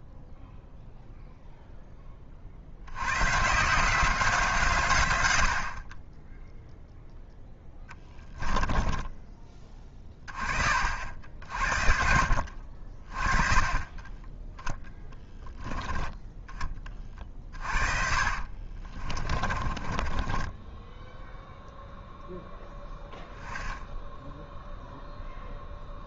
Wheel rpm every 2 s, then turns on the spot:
0, 70, 140, 0, 10, 50, 50, 0, 20, 30, 10, 10, 0.
8-10 16-22